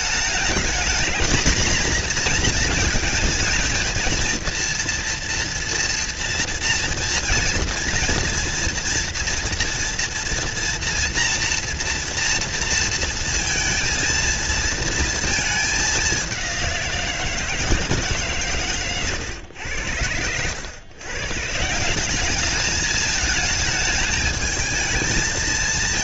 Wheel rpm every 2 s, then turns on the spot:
220, 220, 230, 230, 230, 230, 230, 230, 180, 130, 110, 210, 220.
none